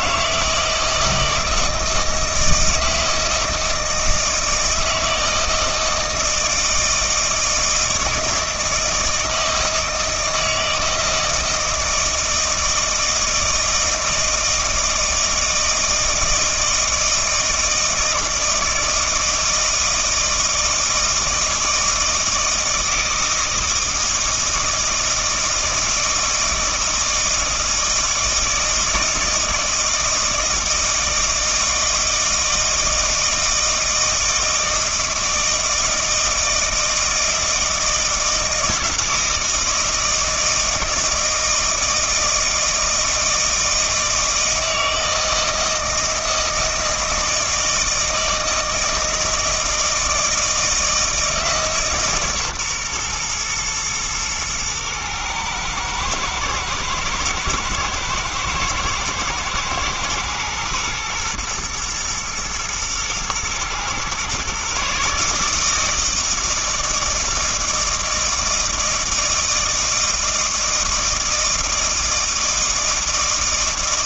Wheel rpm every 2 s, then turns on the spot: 160, 160, 160, 160, 160, 160, 160, 160, 160, 160, 160, 160, 160, 160, 160, 160, 160, 160, 160, 160, 160, 160, 160, 160, 160, 160, 130, 110, 110, 110, 120, 110, 140, 160, 160, 160, 160.
none